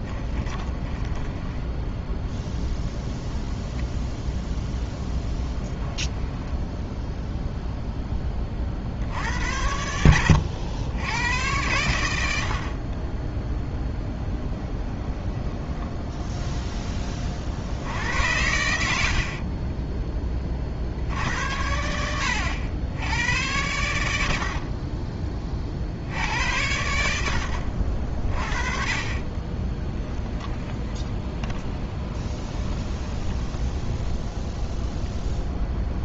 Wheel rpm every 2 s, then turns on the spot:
20, 10, 0, 10, 60, 90, 40, 10, 20, 70, 60, 80, 30, 90, 30, 10, 20, 10.
0-2 6-8 14-16 30-34